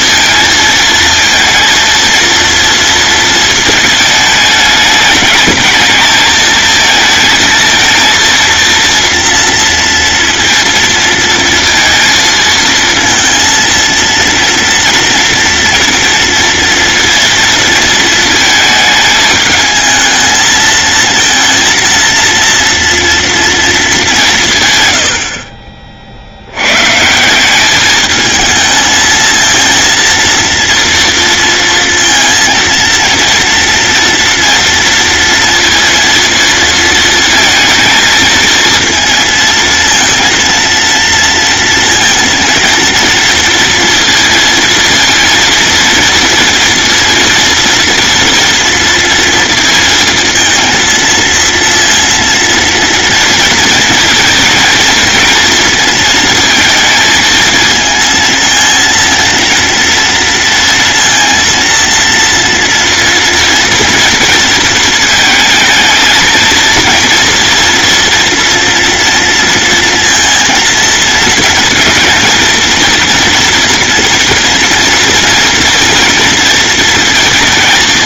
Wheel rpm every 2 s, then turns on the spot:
230, 230, 210, 220, 230, 230, 230, 230, 230, 220, 220, 230, 120, 130, 220, 230, 230, 230, 230, 220, 230, 230, 230, 230, 230, 230, 230, 220, 220, 230, 230, 230, 230, 230, 240, 230, 230, 230, 230.
none